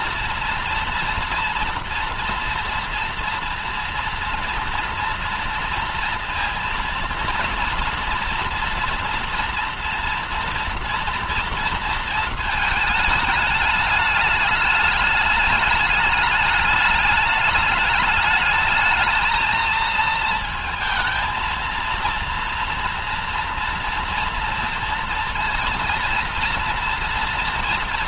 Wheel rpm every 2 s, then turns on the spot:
230, 230, 230, 230, 230, 230, 220, 210, 210, 210, 220, 230, 230, 230.
none